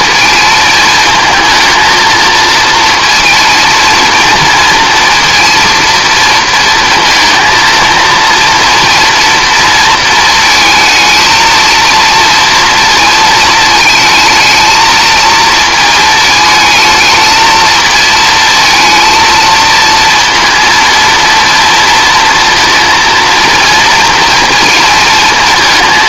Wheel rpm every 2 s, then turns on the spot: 220, 230, 230, 230, 230, 230, 230, 220, 220, 220, 230, 230, 230.
none